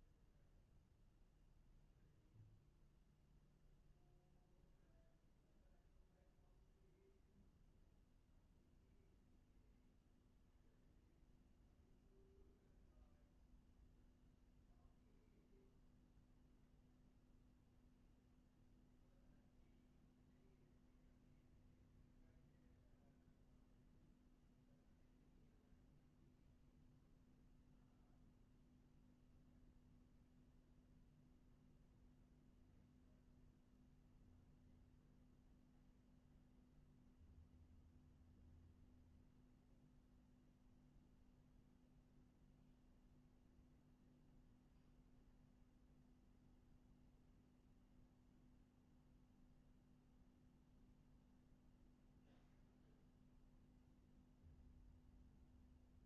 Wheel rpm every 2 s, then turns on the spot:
0, 0, 0, 0, 0, 0, 0, 0, 0, 0, 0, 0, 0, 0, 0, 0, 0, 0, 0, 0, 0, 0, 0, 0, 0, 0, 0, 0.
none